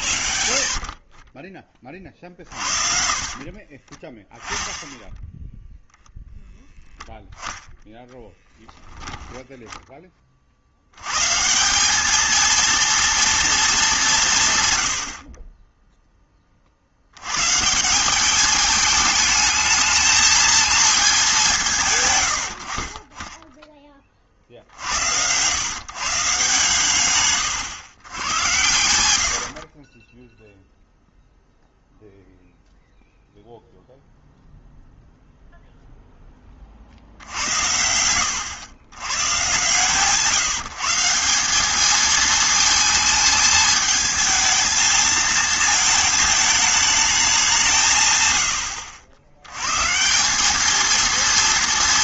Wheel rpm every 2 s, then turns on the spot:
60, 50, 10, 0, 10, 70, 220, 130, 40, 210, 220, 60, 60, 140, 90, 0, 0, 0, 30, 100, 150, 220, 220, 220, 90, 210.
2-4 22-24